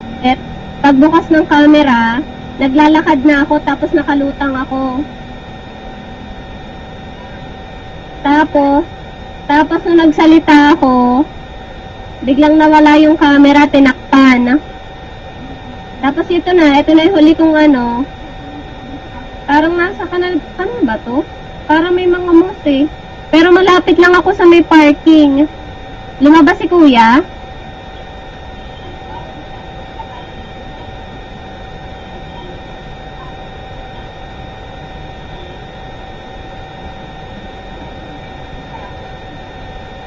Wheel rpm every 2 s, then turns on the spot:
0, 0, 0, 0, 0, 0, 0, 0, 0, 0, 0, 0, 0, 0, 0, 0, 0, 0, 0, 0.
none